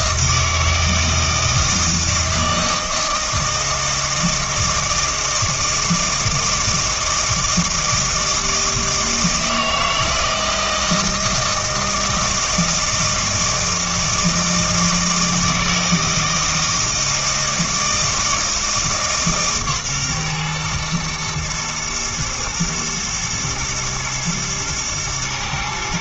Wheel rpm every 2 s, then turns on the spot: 160, 160, 160, 160, 160, 160, 160, 160, 160, 160, 120, 110, 110.
none